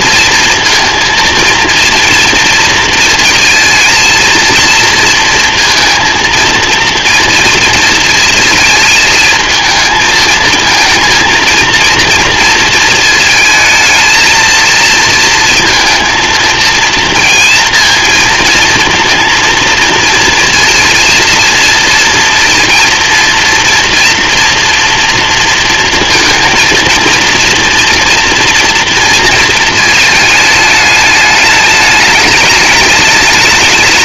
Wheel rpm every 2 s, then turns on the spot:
230, 230, 230, 230, 230, 220, 230, 220, 230, 230, 230, 230, 240, 230, 240, 220, 210.
none